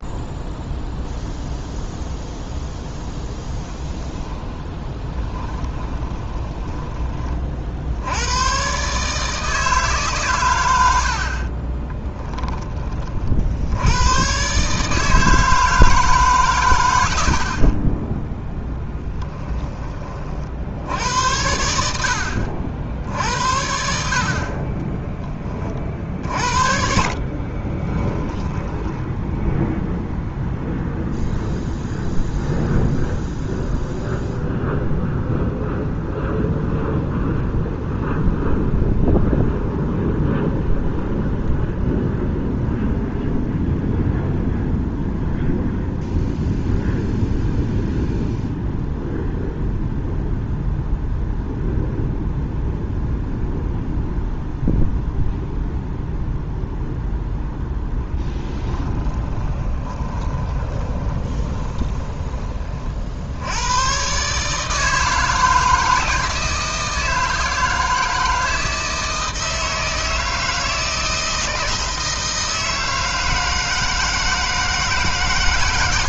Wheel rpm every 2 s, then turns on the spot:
0, 0, 10, 20, 130, 80, 30, 150, 110, 10, 70, 60, 30, 50, 10, 0, 0, 0, 0, 0, 0, 0, 0, 0, 0, 0, 0, 0, 0, 20, 20, 50, 160, 160, 160, 160, 160, 150.
4-6 18-20 26-30 58-62